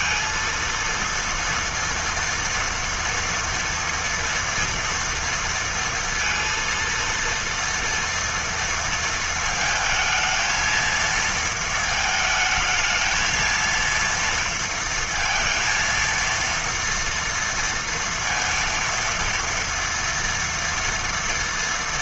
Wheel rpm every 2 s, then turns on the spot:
230, 230, 230, 230, 230, 230, 220, 230, 230, 230, 230.
none